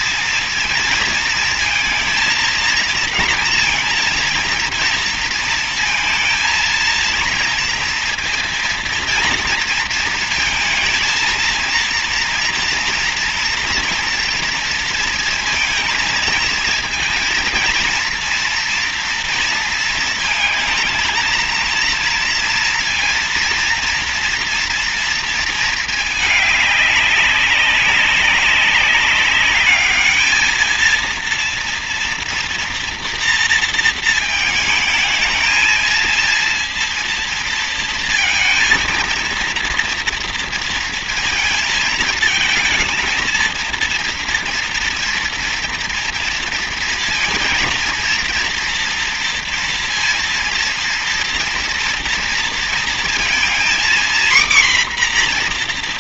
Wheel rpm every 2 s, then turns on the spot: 230, 230, 230, 230, 230, 220, 230, 230, 230, 230, 220, 230, 230, 210, 200, 220, 230, 220, 230, 230, 230, 220, 230, 230, 230, 230, 230, 250.
none